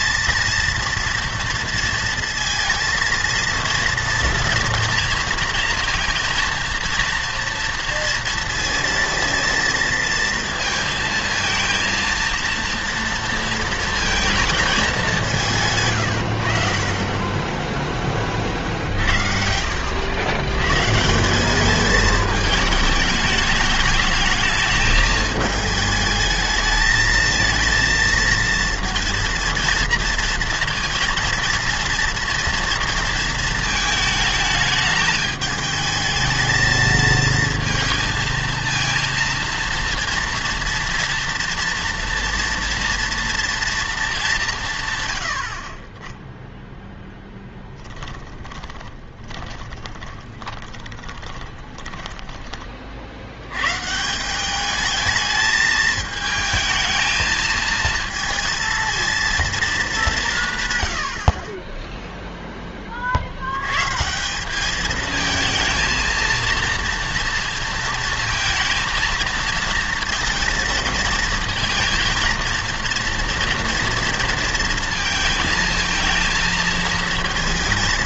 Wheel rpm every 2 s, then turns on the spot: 230, 230, 230, 230, 230, 220, 230, 220, 60, 40, 120, 220, 220, 220, 230, 230, 230, 210, 220, 230, 230, 230, 150, 0, 30, 20, 30, 200, 220, 230, 130, 20, 200, 230, 230, 230, 230, 230, 230.
48-52